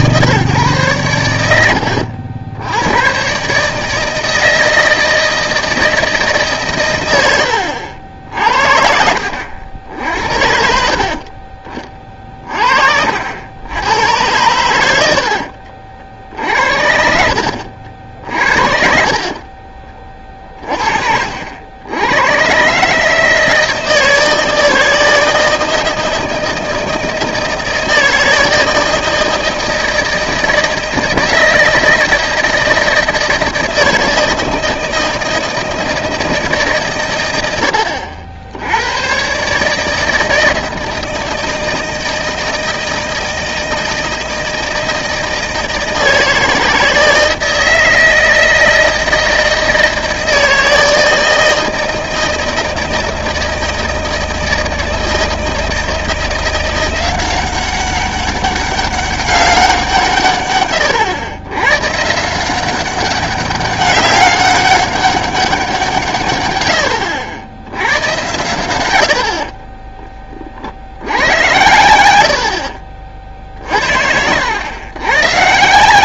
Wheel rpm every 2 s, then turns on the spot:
130, 80, 160, 140, 60, 60, 40, 100, 60, 50, 30, 130, 160, 160, 160, 160, 160, 160, 150, 80, 160, 160, 160, 160, 160, 160, 160, 160, 170, 200, 120, 180, 190, 110, 100, 50, 50, 100.
18-22 72-74